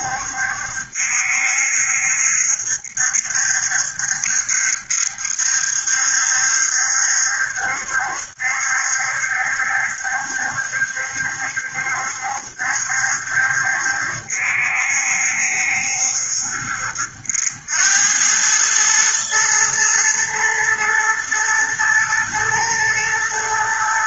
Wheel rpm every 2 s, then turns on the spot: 70, 70, 70, 70, 70, 70, 70, 70, 80, 110, 120, 120.
none